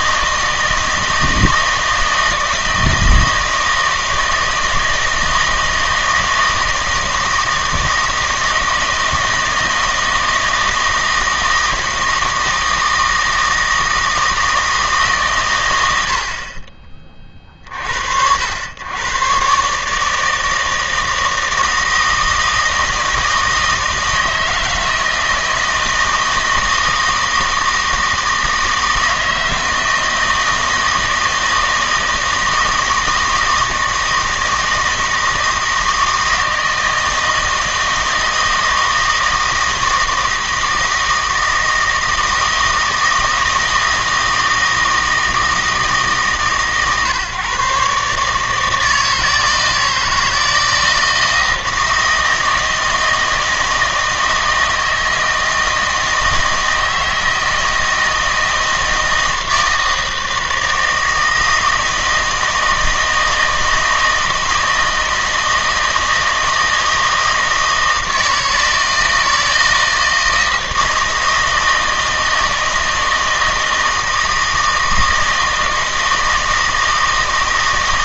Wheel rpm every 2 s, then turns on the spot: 160, 160, 160, 160, 160, 160, 160, 160, 40, 100, 160, 160, 160, 160, 160, 160, 160, 160, 160, 160, 160, 160, 160, 140, 160, 160, 160, 160, 160, 160, 160, 160, 160, 160, 160, 160, 160, 160, 160.
none